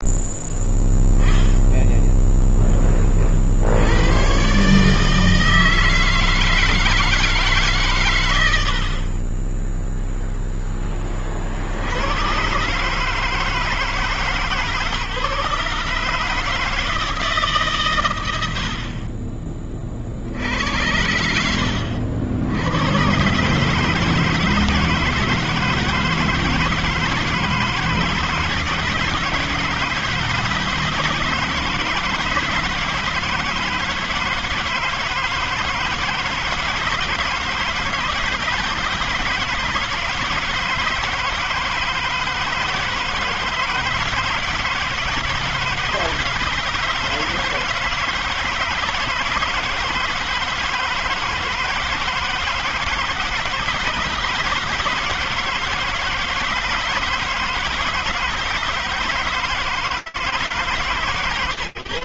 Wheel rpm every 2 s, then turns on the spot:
0, 0, 120, 160, 100, 0, 110, 160, 150, 90, 60, 70, 150, 170, 160, 160, 160, 160, 160, 160, 160, 160, 160, 160, 160, 160, 160, 160, 160, 160, 160.
8-10